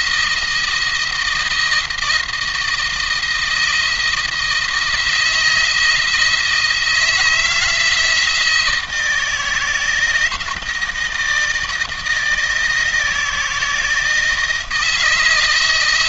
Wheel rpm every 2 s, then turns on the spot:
170, 170, 160, 170, 160, 160, 160, 160.
none